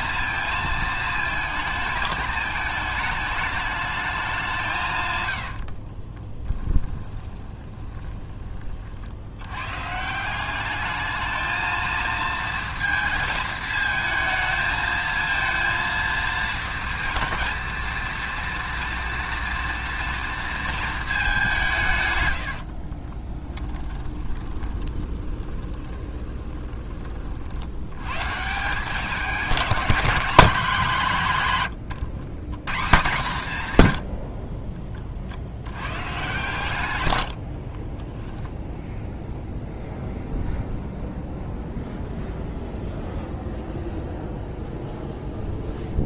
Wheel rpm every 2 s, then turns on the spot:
220, 210, 150, 20, 50, 210, 230, 220, 230, 230, 230, 60, 20, 30, 170, 200, 160, 30, 130, 0, 0, 0, 0.
6-8 22-28